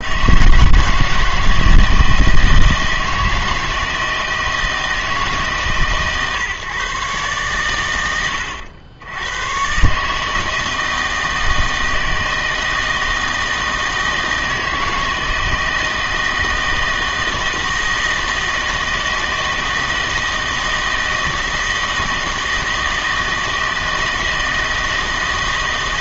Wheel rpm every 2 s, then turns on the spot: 160, 160, 160, 140, 90, 160, 160, 160, 160, 160, 160, 160, 160.
none